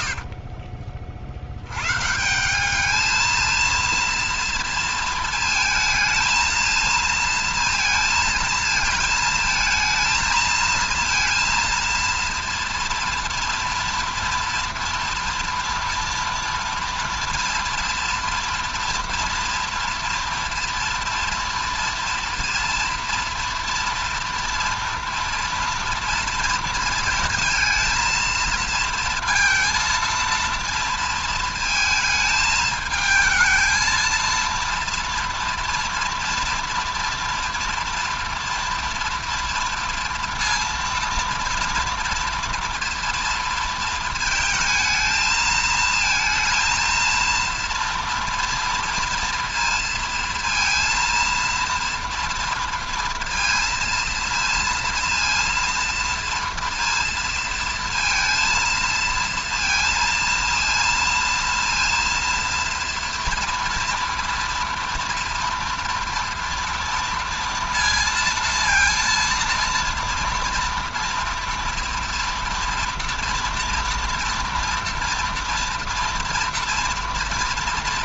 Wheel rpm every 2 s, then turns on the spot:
50, 180, 230, 230, 220, 220, 230, 230, 230, 230, 230, 230, 240, 230, 230, 230, 220, 230, 240, 230, 230, 230, 220, 230, 230, 230, 230, 230, 230, 230, 230, 230, 230, 230, 230, 230, 230, 230, 240.
0-2